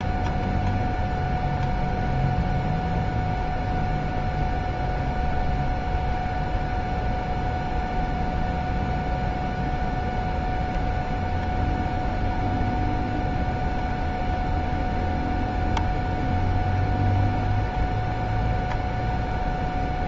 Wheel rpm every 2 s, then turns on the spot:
0, 0, 0, 0, 0, 0, 0, 0, 0, 0.
none